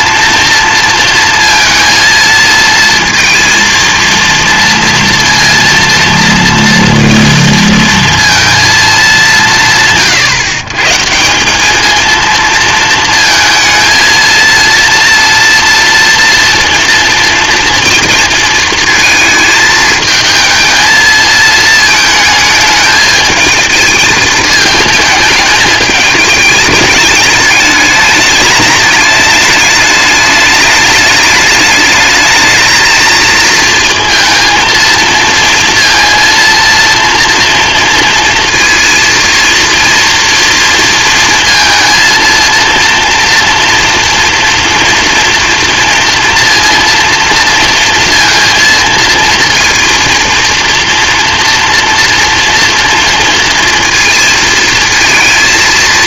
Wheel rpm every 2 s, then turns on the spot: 230, 230, 230, 230, 220, 140, 230, 230, 230, 230, 220, 220, 220, 220, 210, 210, 220, 230, 230, 230, 240, 230, 240, 230, 230, 230, 230, 230.
none